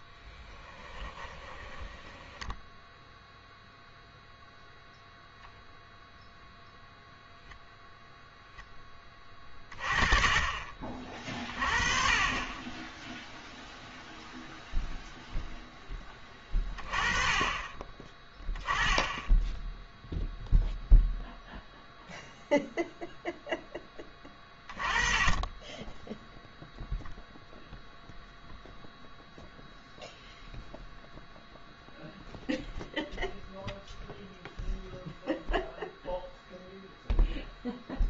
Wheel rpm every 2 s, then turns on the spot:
20, 10, 0, 0, 10, 30, 20, 0, 20, 10, 0, 0, 20, 0, 0, 0, 0, 0, 0.
0-2